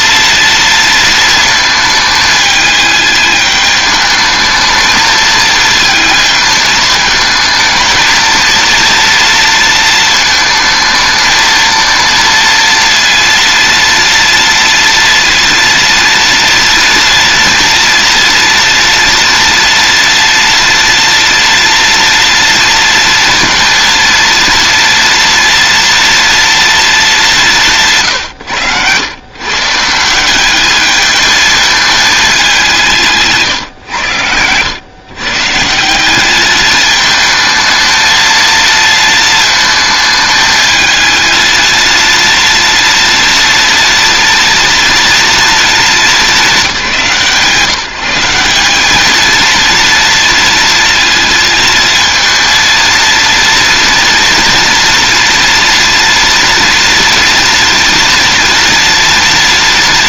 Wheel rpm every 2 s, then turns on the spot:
230, 210, 220, 220, 230, 220, 230, 230, 230, 230, 230, 230, 230, 230, 110, 210, 190, 100, 210, 230, 220, 230, 230, 190, 180, 230, 230, 230, 240, 230.
none